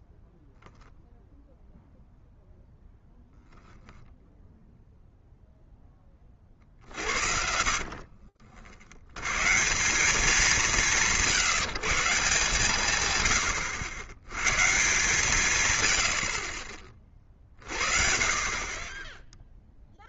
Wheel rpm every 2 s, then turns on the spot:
0, 0, 0, 30, 70, 180, 140, 130, 50, 30.
none